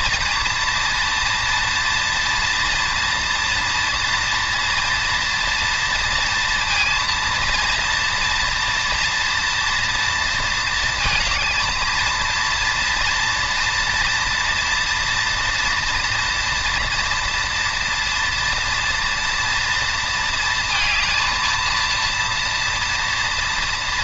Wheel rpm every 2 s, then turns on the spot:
230, 240, 230, 230, 240, 230, 230, 230, 230, 230, 230, 240.
none